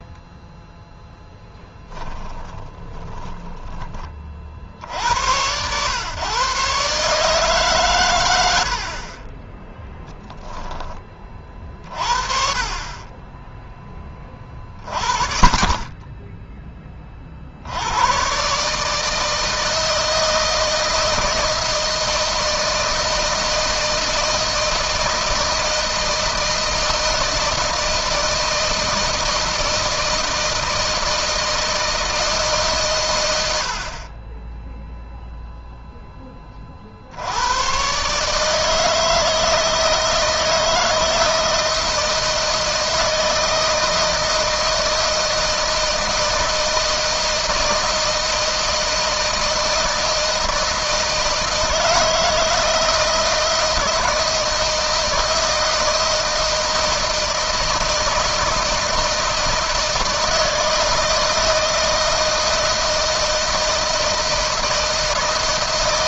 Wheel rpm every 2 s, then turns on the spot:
0, 10, 80, 140, 50, 30, 30, 50, 30, 150, 160, 160, 160, 160, 160, 160, 120, 0, 60, 160, 160, 160, 160, 160, 160, 160, 160, 160, 160, 160, 160, 160, 160.
2-4